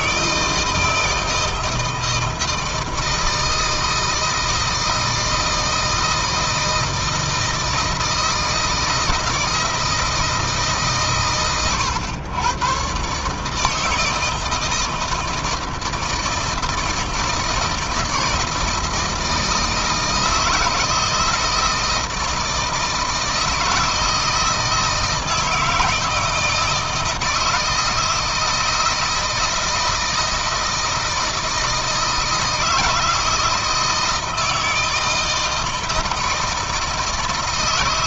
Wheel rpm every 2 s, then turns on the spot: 160, 160, 160, 160, 160, 150, 120, 160, 160, 160, 160, 160, 160, 160, 160, 160, 160, 160, 160.
none